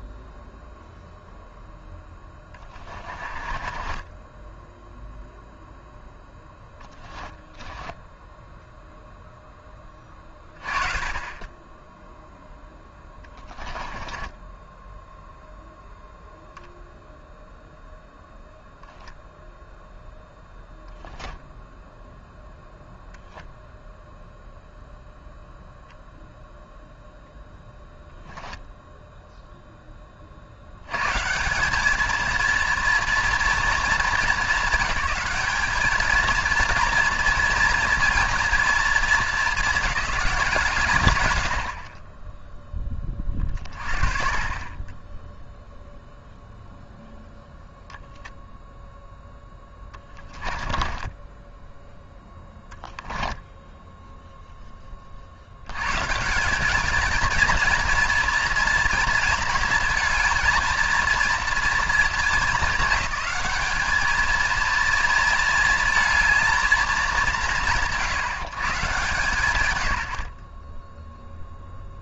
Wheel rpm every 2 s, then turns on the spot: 0, 20, 0, 20, 0, 30, 10, 10, 0, 10, 0, 0, 0, 0, 0, 110, 230, 210, 230, 220, 100, 20, 10, 0, 0, 20, 10, 20, 220, 230, 230, 210, 230, 170, 160, 20.
2-4 6-8 12-16 50-54